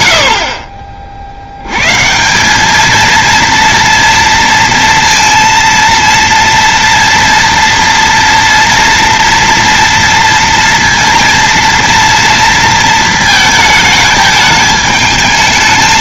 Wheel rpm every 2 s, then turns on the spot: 50, 210, 230, 230, 240, 230, 230, 210.
none